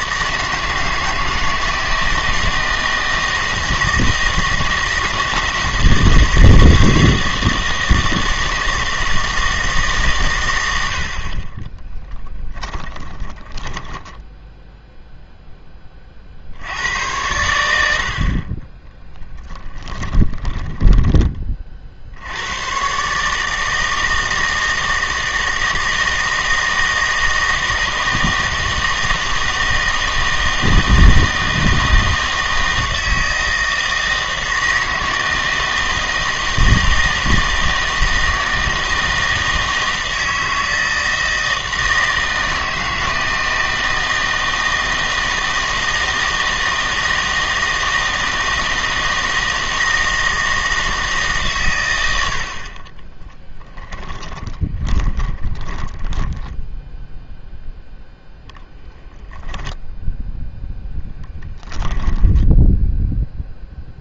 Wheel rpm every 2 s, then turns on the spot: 160, 160, 160, 160, 160, 90, 20, 0, 80, 20, 10, 110, 160, 160, 160, 160, 160, 160, 160, 160, 160, 160, 160, 160, 160, 160, 40, 20, 10, 0, 0, 10.
12-14 20-22 54-58 62-64